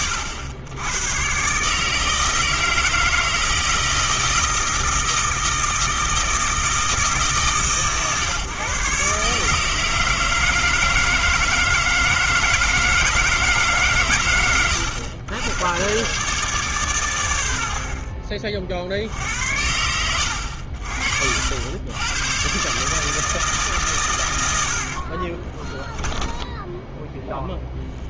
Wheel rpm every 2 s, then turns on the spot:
110, 160, 160, 160, 140, 160, 160, 110, 130, 30, 60, 140, 60, 10.
26-28